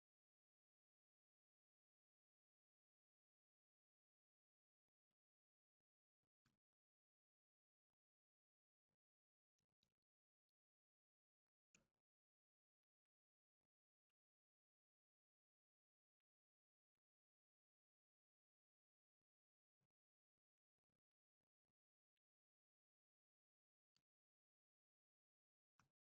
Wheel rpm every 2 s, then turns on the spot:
0, 0, 0, 0, 0, 0, 0, 0, 0, 0, 0, 0, 0.
none